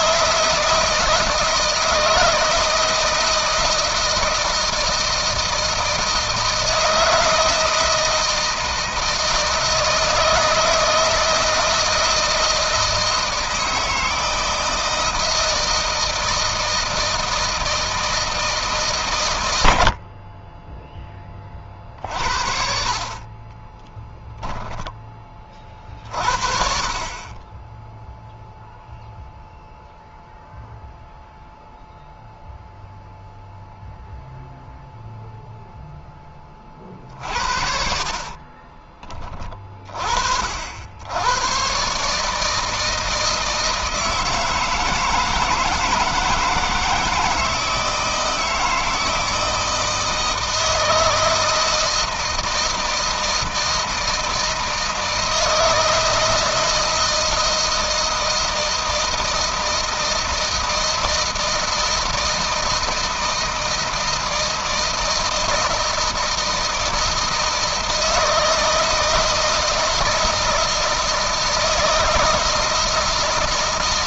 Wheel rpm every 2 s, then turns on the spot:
160, 160, 160, 160, 160, 160, 160, 160, 160, 160, 30, 50, 10, 50, 0, 0, 0, 0, 20, 30, 60, 150, 160, 160, 160, 160, 160, 160, 160, 160, 160, 160, 160, 160, 160, 160, 160.
24-26 38-40